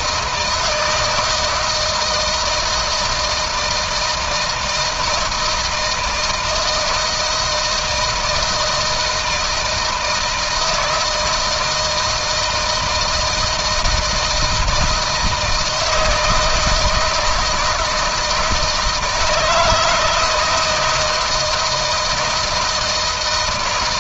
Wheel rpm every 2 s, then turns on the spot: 160, 160, 160, 160, 170, 160, 160, 160, 160, 160, 160, 160.
none